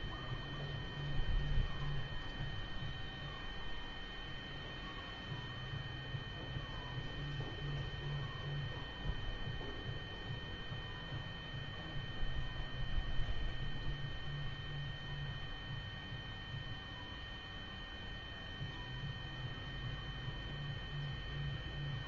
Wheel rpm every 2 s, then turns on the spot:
0, 0, 0, 0, 0, 0, 0, 0, 0, 0, 0.
none